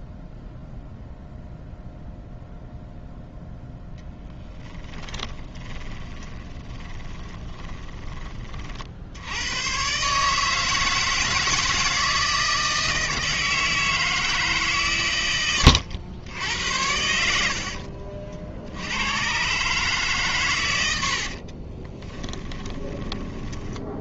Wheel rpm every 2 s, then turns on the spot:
0, 0, 20, 20, 50, 160, 160, 120, 80, 80, 100, 20.
4-8 22-24